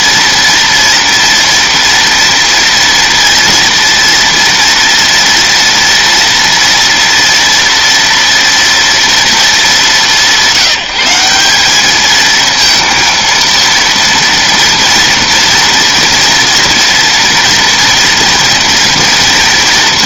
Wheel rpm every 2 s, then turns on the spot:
230, 230, 230, 230, 230, 180, 230, 230, 230, 230.
none